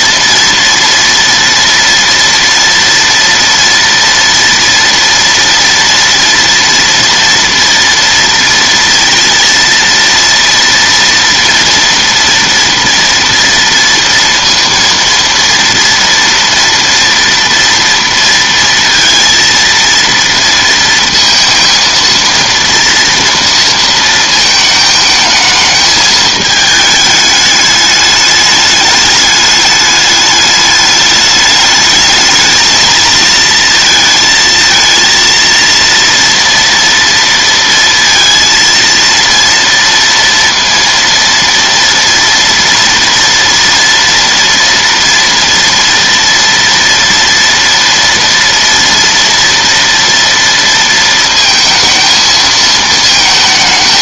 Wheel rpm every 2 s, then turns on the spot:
230, 240, 230, 230, 230, 230, 230, 230, 230, 230, 230, 230, 220, 220, 210, 210, 220, 230, 230, 230, 230, 230, 230, 230, 230, 230, 220.
none